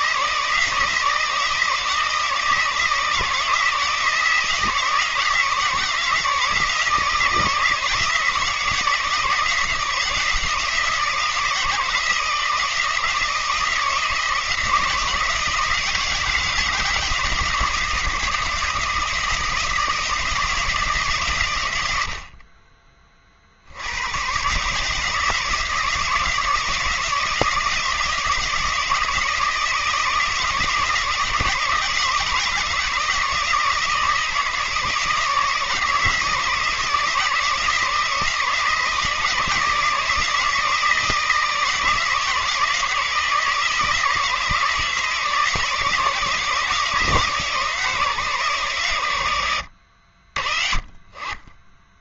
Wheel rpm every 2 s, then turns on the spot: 160, 170, 160, 160, 160, 170, 160, 160, 160, 160, 160, 30, 140, 160, 170, 160, 160, 160, 160, 160, 160, 160, 160, 160, 130, 50.
none